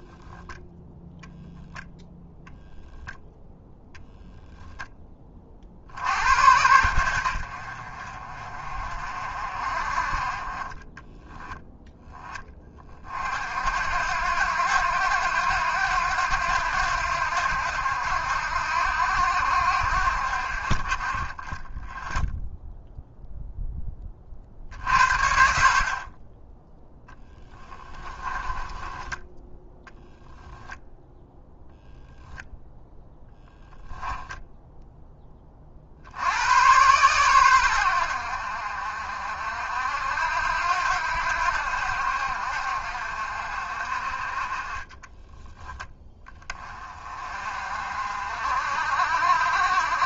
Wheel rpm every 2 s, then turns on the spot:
0, 0, 20, 80, 40, 20, 40, 90, 80, 70, 40, 0, 50, 10, 10, 0, 0, 10, 110, 60, 80, 60, 20, 30, 60.
4-6 10-12 26-30